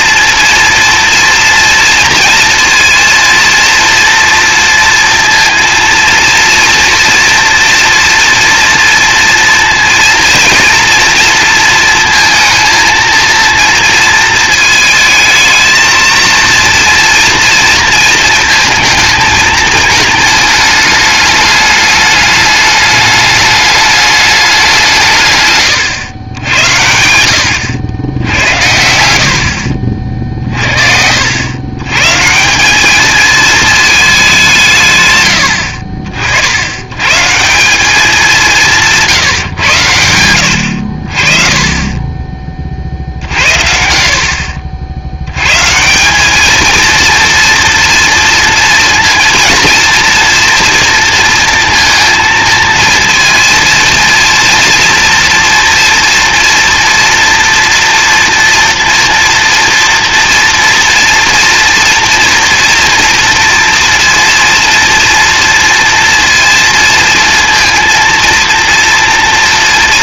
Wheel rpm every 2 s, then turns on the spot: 230, 230, 230, 230, 230, 230, 230, 220, 230, 220, 210, 210, 130, 90, 60, 90, 220, 100, 160, 140, 40, 70, 100, 230, 230, 230, 230, 240, 230, 230, 230, 240, 230, 230, 230.
40-42